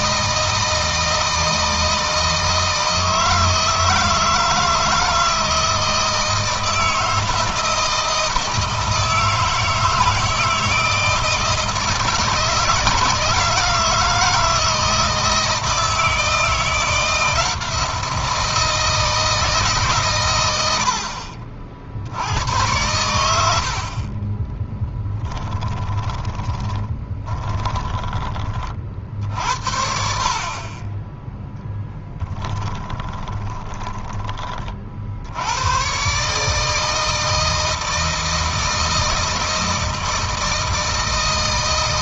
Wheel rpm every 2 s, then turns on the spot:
160, 160, 160, 160, 160, 160, 160, 160, 170, 160, 80, 100, 20, 20, 40, 30, 20, 40, 150, 160, 160.
22-28 32-34